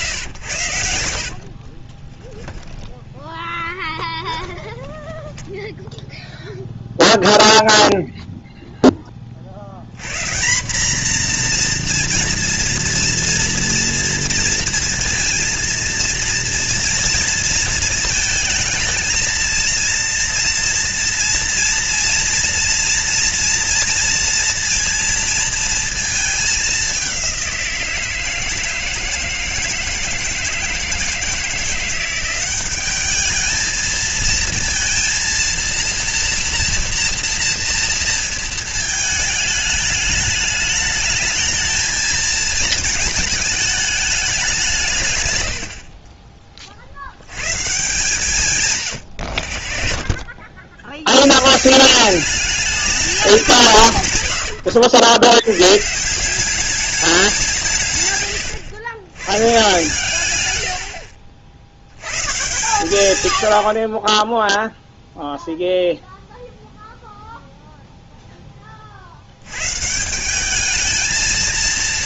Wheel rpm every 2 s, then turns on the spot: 100, 10, 10, 0, 0, 180, 240, 230, 230, 220, 230, 240, 230, 210, 160, 160, 190, 230, 230, 220, 210, 220, 190, 40, 150, 60, 200, 90, 180, 110, 100, 130, 10, 0, 10, 200.
2-4